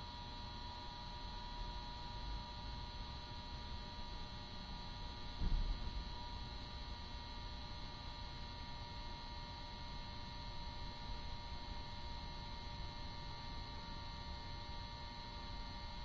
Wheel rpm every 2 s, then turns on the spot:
0, 0, 0, 0, 0, 0, 0, 0.
none